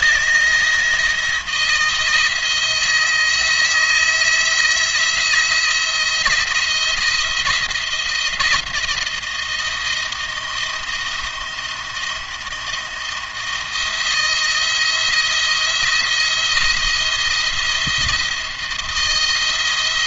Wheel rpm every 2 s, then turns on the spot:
160, 160, 170, 170, 170, 170, 170, 170, 170, 170.
none